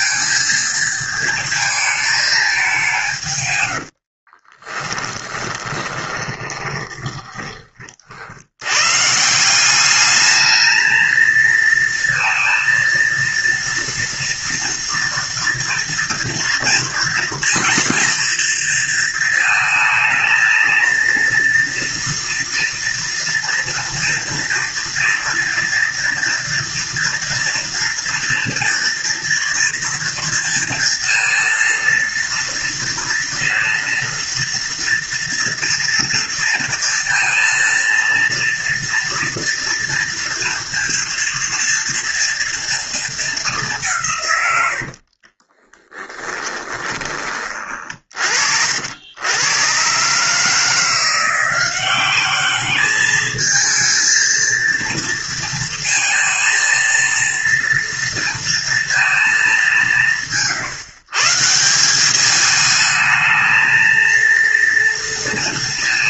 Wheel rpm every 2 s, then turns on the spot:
230, 190, 20, 30, 110, 220, 230, 230, 230, 230, 230, 240, 230, 230, 230, 230, 230, 230, 230, 230, 230, 230, 90, 20, 70, 160, 210, 230, 230, 230, 150, 210, 230.
4-8 44-48